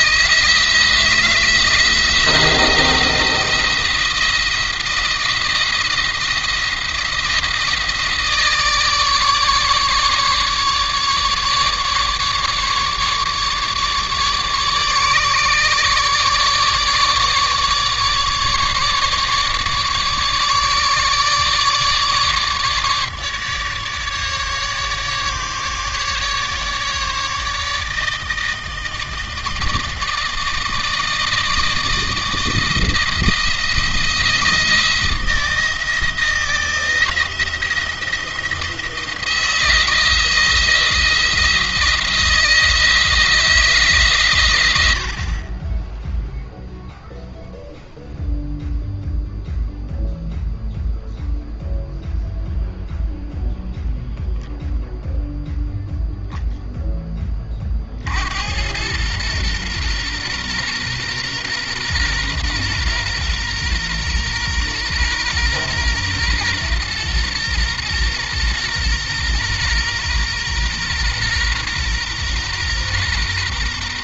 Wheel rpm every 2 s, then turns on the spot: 170, 170, 170, 170, 150, 150, 150, 150, 150, 150, 150, 150, 150, 150, 160, 160, 170, 160, 170, 170, 170, 170, 80, 0, 0, 0, 0, 0, 10, 90, 120, 120, 120, 120, 120, 120, 120.
none